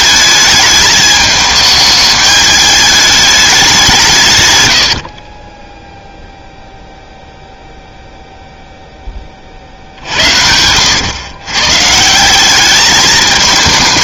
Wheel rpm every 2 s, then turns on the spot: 210, 210, 110, 0, 0, 90, 200.
none